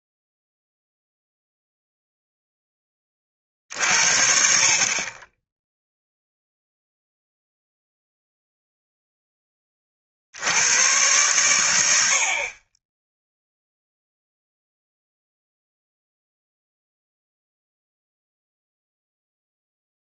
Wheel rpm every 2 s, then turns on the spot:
0, 10, 50, 0, 0, 90, 30, 0, 0, 0.
none